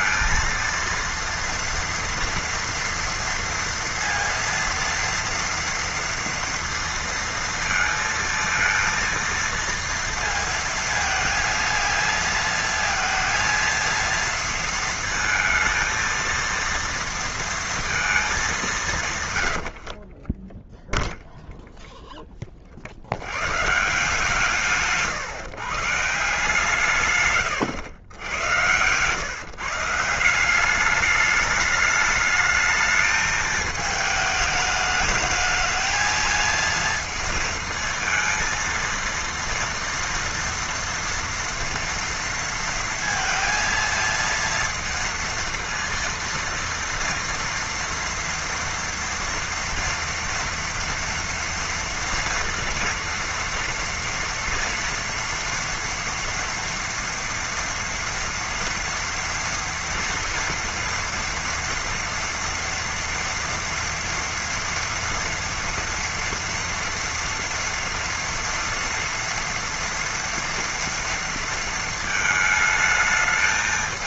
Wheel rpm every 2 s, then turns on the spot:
230, 230, 230, 230, 230, 230, 230, 230, 230, 190, 10, 30, 160, 160, 100, 190, 210, 210, 230, 230, 230, 230, 230, 230, 230, 240, 230, 230, 230, 230, 230, 230, 230, 230, 230, 230, 220.
none